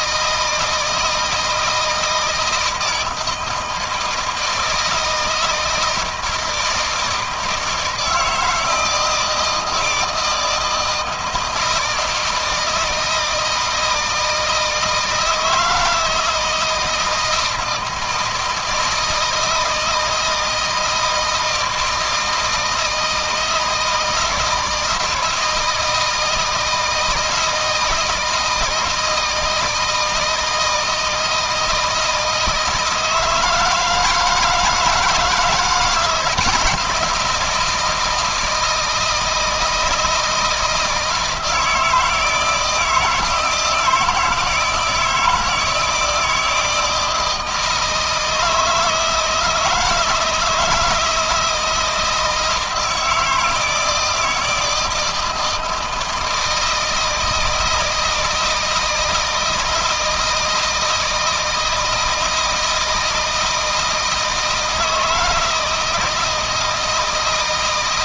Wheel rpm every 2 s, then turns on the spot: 160, 160, 160, 160, 160, 160, 160, 160, 160, 160, 160, 160, 170, 160, 160, 160, 160, 160, 170, 160, 160, 160, 170, 160, 160, 160, 160, 160, 160, 160, 160, 160, 160, 160.
none